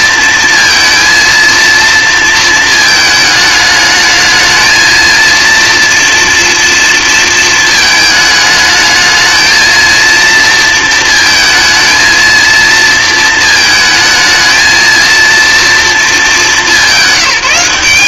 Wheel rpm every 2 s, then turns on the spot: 230, 230, 220, 230, 220, 230, 230, 220, 210.
none